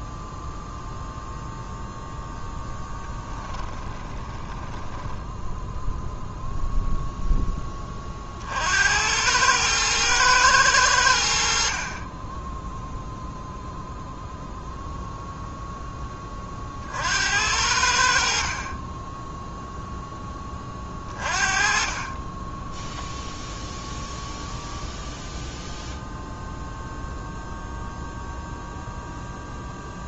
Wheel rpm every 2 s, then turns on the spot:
0, 10, 10, 0, 80, 100, 0, 0, 60, 20, 30, 0, 0, 0, 0.
2-6